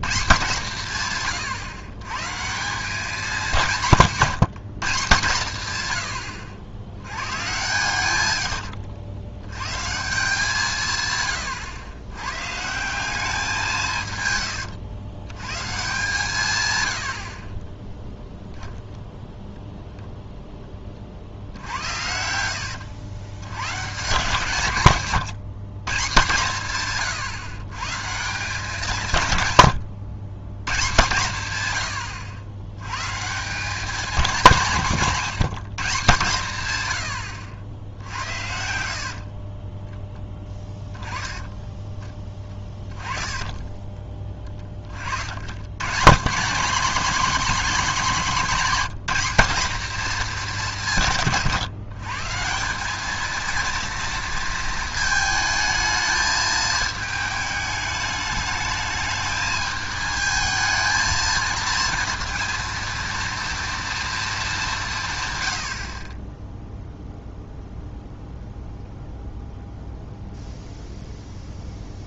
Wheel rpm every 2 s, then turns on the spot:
140, 190, 170, 90, 90, 160, 170, 110, 100, 10, 30, 90, 150, 140, 180, 150, 120, 180, 110, 70, 10, 20, 30, 190, 200, 180, 200, 220, 220, 210, 220, 230, 170, 0, 0, 0.
38-40 42-44